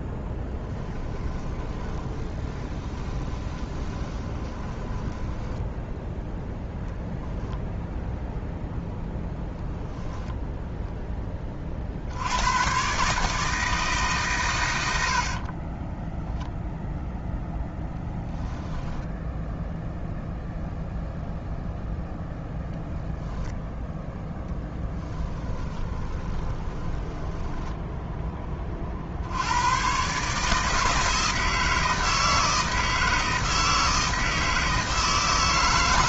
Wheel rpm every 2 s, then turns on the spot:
10, 20, 20, 0, 0, 0, 120, 100, 0, 0, 0, 0, 10, 30, 30, 150, 160, 160.
0-6 24-28